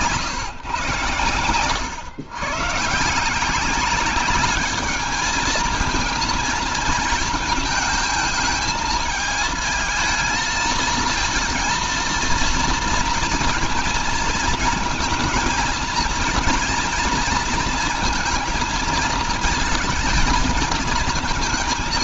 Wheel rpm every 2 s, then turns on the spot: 120, 130, 210, 230, 220, 220, 230, 230, 230, 220, 230.
none